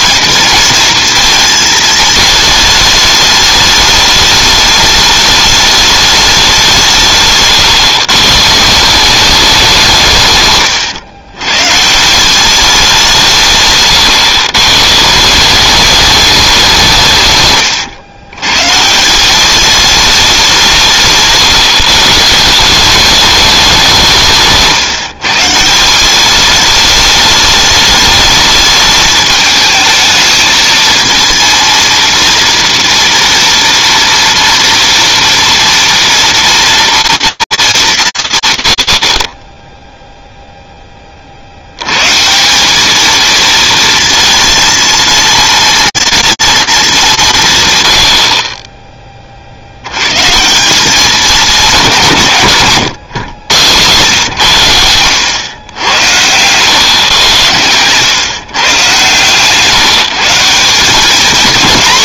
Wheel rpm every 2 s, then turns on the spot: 230, 210, 210, 180, 160, 120, 190, 120, 190, 140, 180, 170, 150, 210, 210, 220, 230, 230, 230, 90, 20, 200, 230, 210, 20, 180, 140, 110, 120, 130, 180.
10-12 52-54